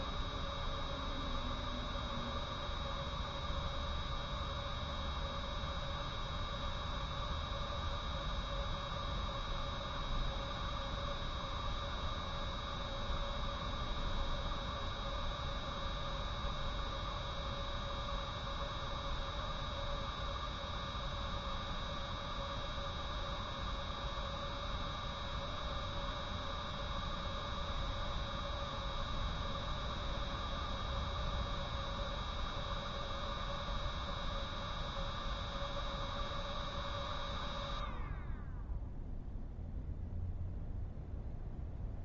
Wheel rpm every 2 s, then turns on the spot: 0, 0, 0, 0, 0, 0, 0, 0, 0, 0, 0, 0, 0, 0, 0, 0, 0, 0, 0, 0, 0.
none